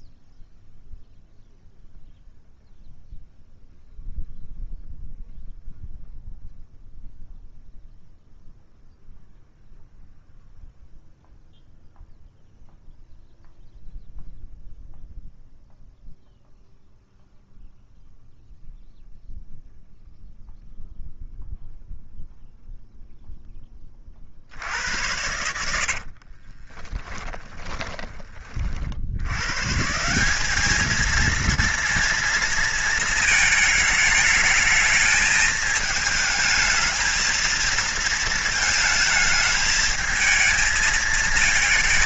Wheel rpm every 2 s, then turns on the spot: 0, 0, 0, 0, 0, 0, 0, 0, 0, 0, 0, 0, 70, 30, 40, 210, 230, 220, 220, 220, 220.
26-28